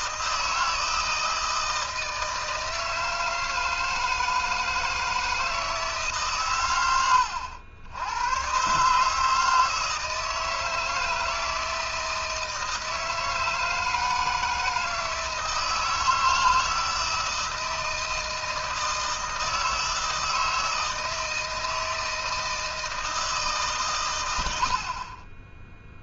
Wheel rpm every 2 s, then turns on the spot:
160, 160, 160, 110, 140, 160, 160, 160, 160, 160, 160, 160, 60.
none